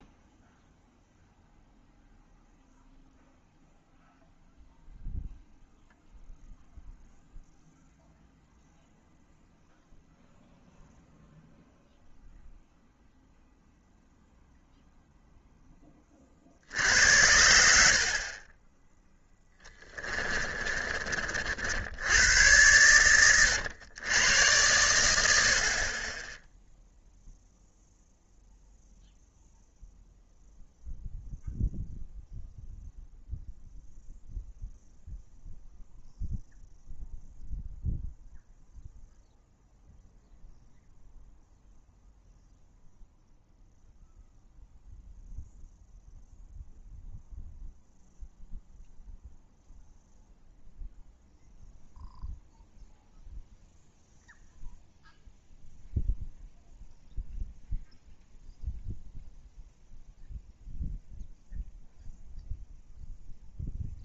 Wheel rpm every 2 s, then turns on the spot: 0, 0, 0, 0, 0, 0, 0, 0, 60, 30, 20, 100, 90, 0, 0, 0, 0, 0, 0, 0, 0, 0, 0, 0, 0, 0, 0, 0, 0, 0, 0, 0.
20-22